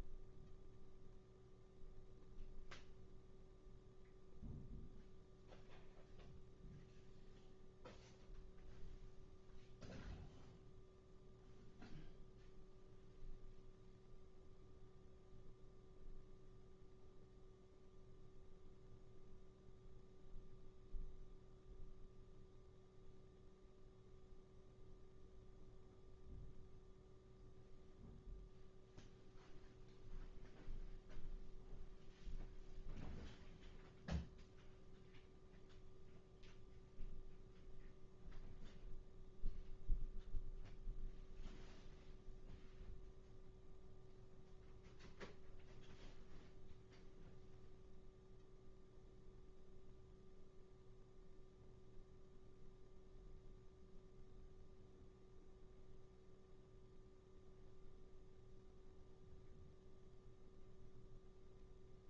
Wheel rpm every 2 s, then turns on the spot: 0, 0, 0, 0, 0, 0, 0, 0, 0, 0, 0, 0, 0, 0, 0, 0, 0, 0, 0, 0, 0, 0, 0, 0, 0, 0, 0, 0, 0, 0, 0.
none